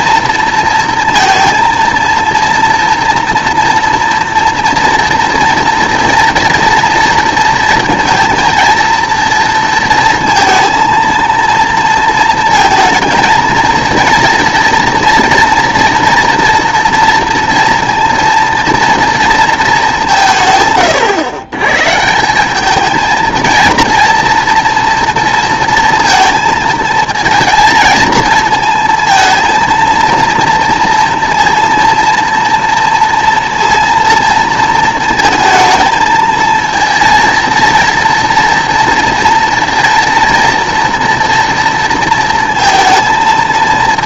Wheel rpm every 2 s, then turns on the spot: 230, 230, 230, 230, 230, 230, 230, 230, 240, 230, 140, 200, 230, 230, 230, 230, 230, 230, 230, 230, 230, 230.
none